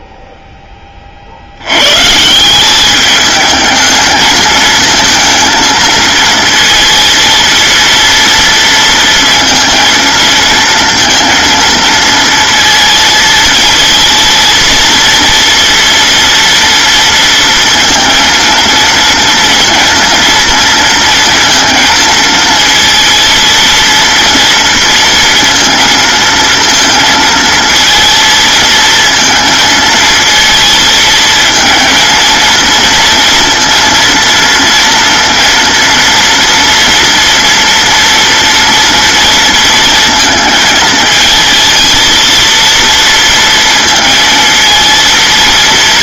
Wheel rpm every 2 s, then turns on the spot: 20, 200, 220, 230, 230, 230, 230, 230, 230, 230, 230, 230, 230, 230, 230, 230, 230, 230, 230, 230, 220, 230, 230.
none